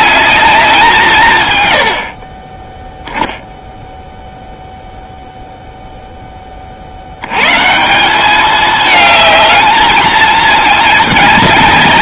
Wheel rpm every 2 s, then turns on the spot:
190, 10, 0, 50, 210, 210.
none